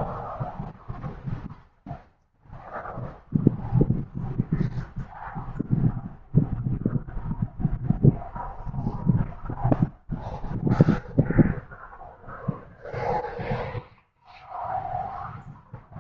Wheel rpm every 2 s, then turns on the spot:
0, 0, 0, 0, 0, 0, 0, 0.
none